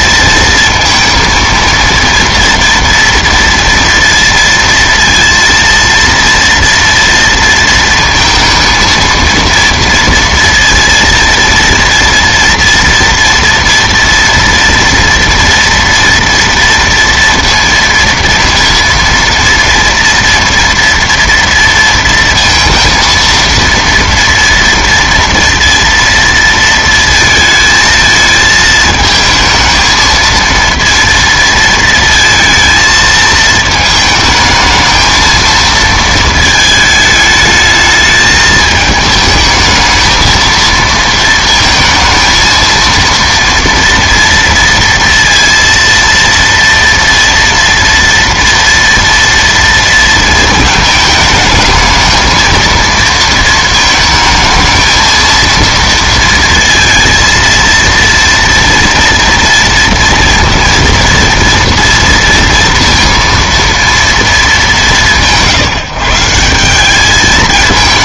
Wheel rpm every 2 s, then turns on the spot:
230, 230, 230, 230, 230, 230, 230, 230, 230, 230, 230, 230, 230, 230, 220, 230, 220, 220, 220, 210, 230, 230, 230, 230, 230, 220, 230, 220, 230, 230, 230, 230, 200, 190.
none